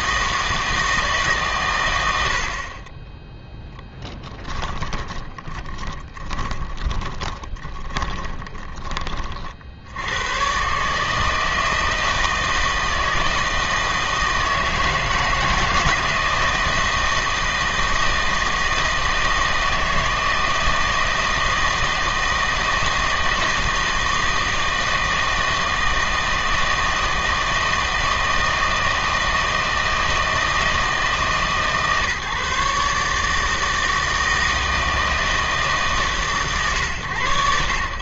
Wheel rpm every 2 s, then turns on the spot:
160, 50, 10, 20, 20, 130, 160, 160, 160, 160, 160, 160, 160, 160, 160, 160, 150, 160, 120.
4-10